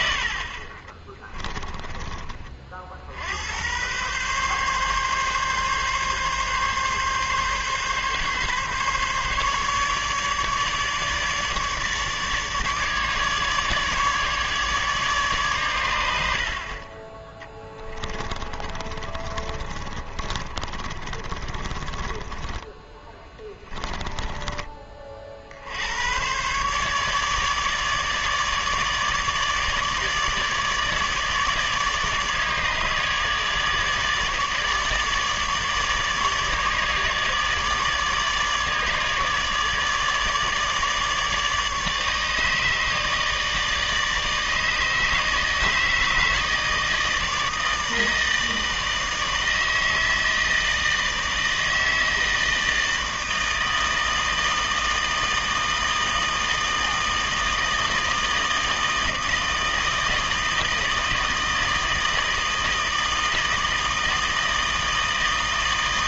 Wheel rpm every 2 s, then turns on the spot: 30, 50, 140, 140, 140, 150, 150, 150, 40, 30, 30, 20, 30, 140, 150, 150, 150, 150, 150, 150, 150, 150, 150, 160, 160, 160, 160, 160, 160, 160, 160, 160, 160.
18-24